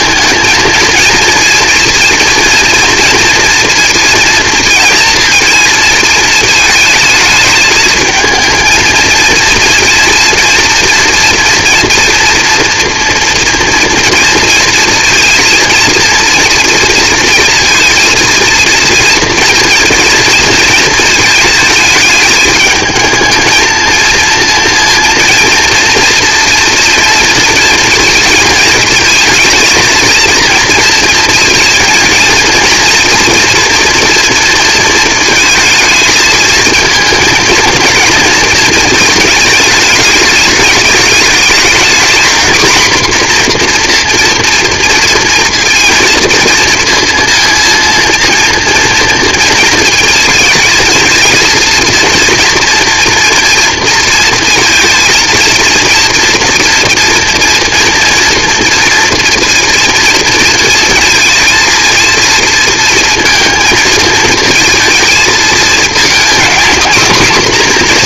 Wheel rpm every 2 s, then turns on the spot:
220, 240, 230, 220, 230, 240, 230, 230, 240, 230, 230, 210, 230, 240, 230, 230, 230, 230, 220, 220, 220, 240, 230, 230, 230, 230, 230, 230, 230, 230, 230, 230, 230, 240.
none